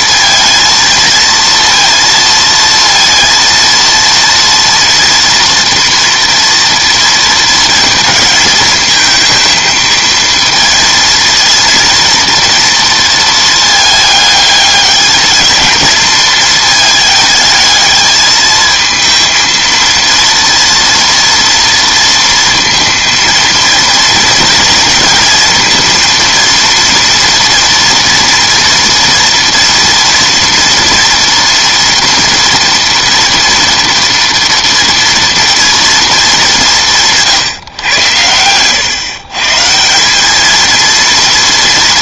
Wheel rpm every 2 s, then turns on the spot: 230, 230, 230, 230, 220, 230, 230, 210, 220, 220, 230, 230, 230, 230, 230, 230, 230, 230, 190, 110, 220.
none